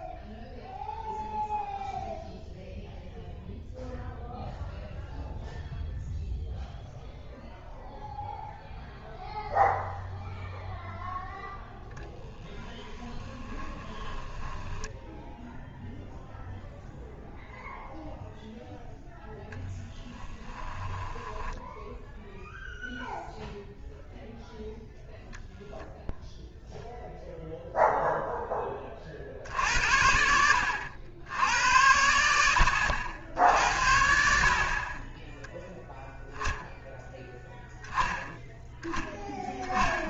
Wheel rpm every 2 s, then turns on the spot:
0, 0, 0, 0, 0, 0, 20, 10, 0, 0, 20, 0, 0, 0, 20, 80, 80, 40, 0, 0.
12-16 20-22